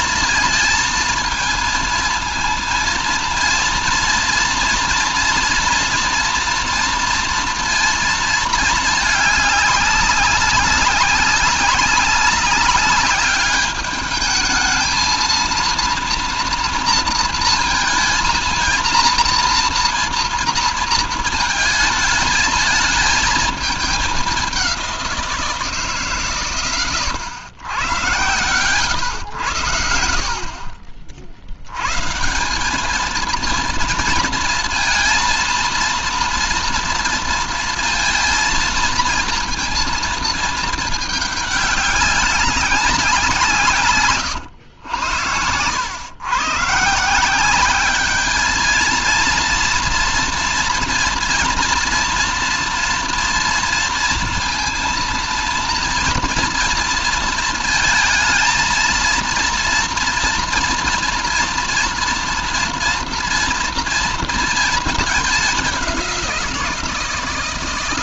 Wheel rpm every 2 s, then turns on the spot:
230, 230, 230, 230, 220, 200, 200, 220, 230, 230, 220, 220, 190, 120, 110, 50, 210, 230, 230, 230, 220, 190, 100, 160, 220, 230, 230, 230, 230, 230, 230, 230, 220, 170.
none